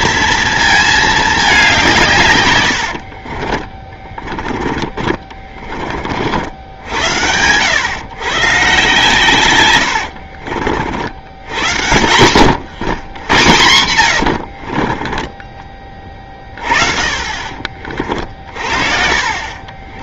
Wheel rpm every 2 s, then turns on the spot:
220, 100, 20, 70, 140, 70, 100, 50, 30, 40.
2-6 14-16